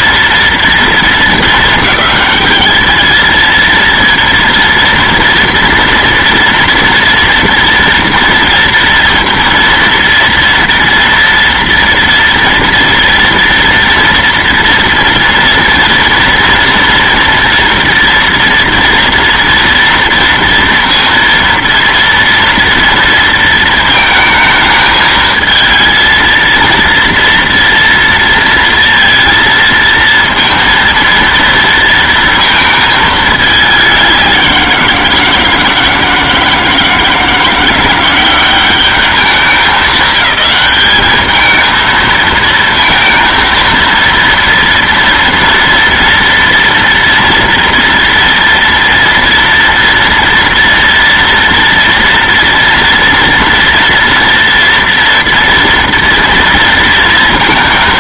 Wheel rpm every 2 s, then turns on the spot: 230, 220, 230, 230, 230, 230, 230, 230, 230, 230, 230, 230, 220, 230, 230, 230, 220, 170, 160, 200, 210, 230, 230, 230, 240, 230, 240, 230, 230.
none